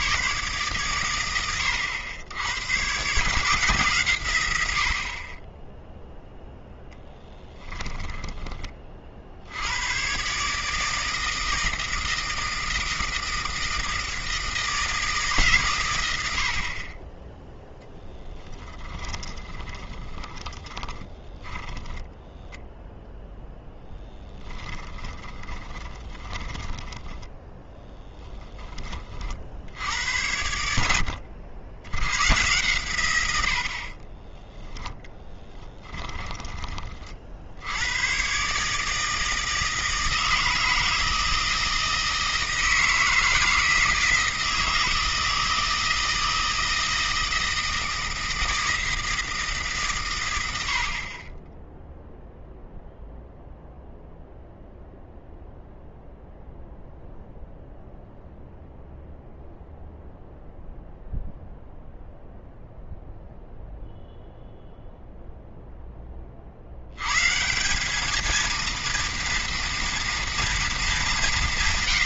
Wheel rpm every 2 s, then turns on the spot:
130, 100, 110, 0, 20, 150, 160, 160, 60, 20, 20, 0, 10, 10, 20, 90, 120, 10, 30, 140, 160, 160, 160, 160, 160, 80, 0, 0, 0, 0, 0, 0, 0, 60, 230, 230.
18-22 24-30 34-36